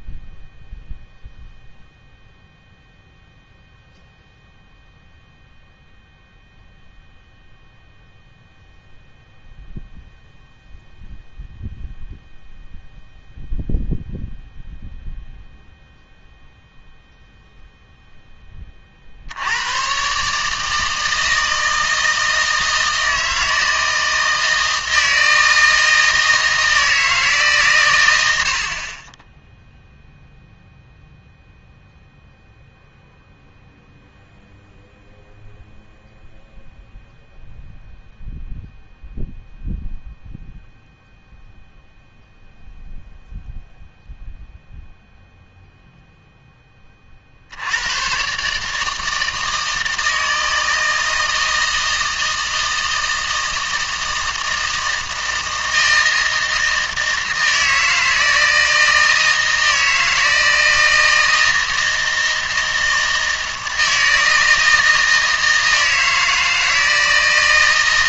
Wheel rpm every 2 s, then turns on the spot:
0, 0, 0, 0, 0, 0, 0, 0, 0, 20, 150, 160, 160, 160, 70, 0, 0, 0, 0, 0, 0, 0, 0, 10, 150, 160, 160, 160, 160, 160, 160, 160, 160, 160.
none